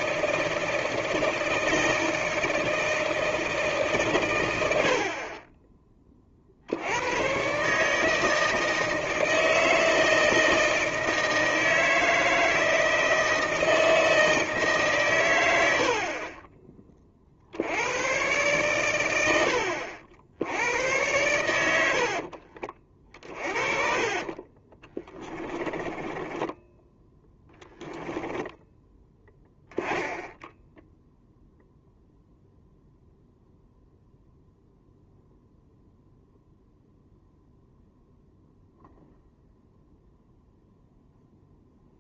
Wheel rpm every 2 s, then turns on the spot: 160, 160, 80, 80, 160, 160, 160, 150, 30, 120, 90, 40, 20, 10, 10, 0, 0, 0, 0, 0, 0.
22-28